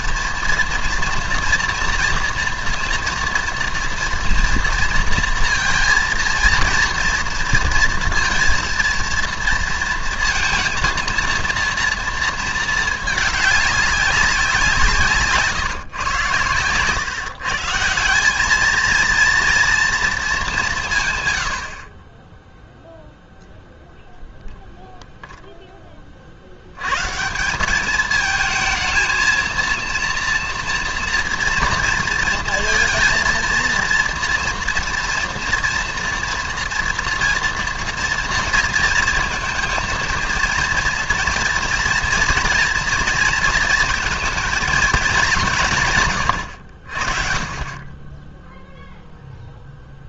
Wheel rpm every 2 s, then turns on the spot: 230, 240, 230, 230, 230, 230, 220, 180, 120, 220, 190, 0, 0, 70, 220, 230, 230, 230, 230, 230, 230, 230, 220, 80, 0.
none